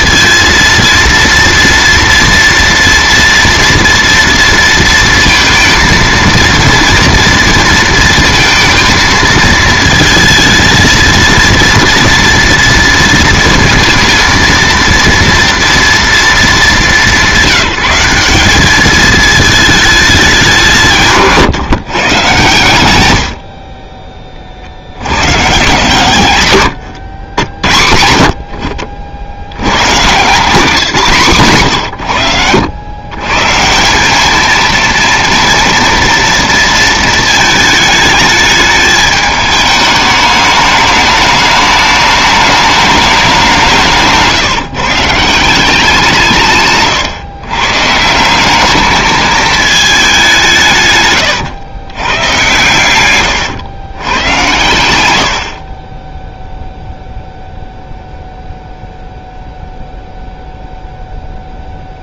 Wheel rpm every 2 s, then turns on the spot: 230, 230, 230, 230, 230, 230, 230, 230, 190, 190, 190, 120, 40, 100, 70, 180, 100, 220, 230, 210, 210, 210, 150, 140, 190, 160, 110, 110, 0, 0, 0.
26-28